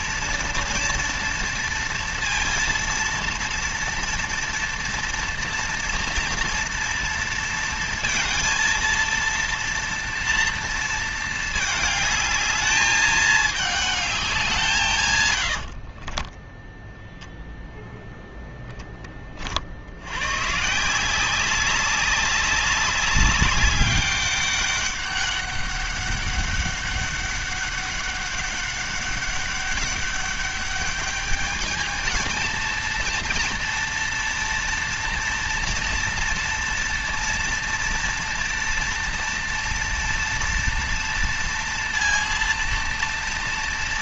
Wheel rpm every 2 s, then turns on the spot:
230, 230, 230, 230, 230, 220, 210, 130, 0, 30, 170, 200, 200, 200, 200, 210, 230, 230, 230, 230, 230, 240.
14-16